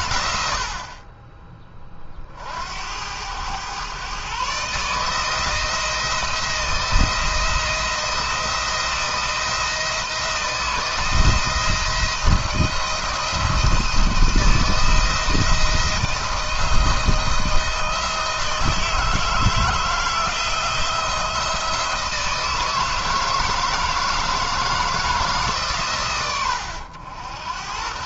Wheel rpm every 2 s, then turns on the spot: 60, 70, 140, 170, 170, 170, 170, 160, 160, 160, 160, 160, 160, 100.
none